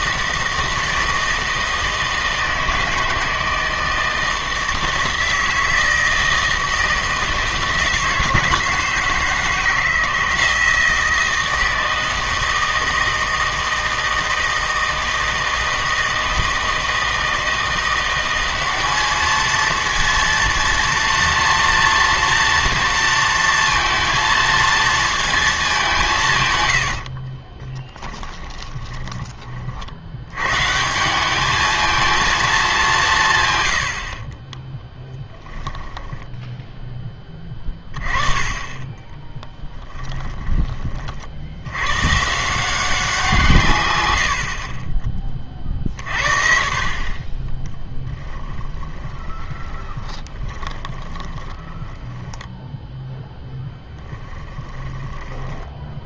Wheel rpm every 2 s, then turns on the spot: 160, 160, 160, 160, 160, 160, 160, 160, 160, 200, 230, 230, 230, 90, 20, 160, 190, 10, 10, 20, 30, 180, 30, 50, 10, 20, 10, 10.
26-30 34-36 44-46 48-52 54-56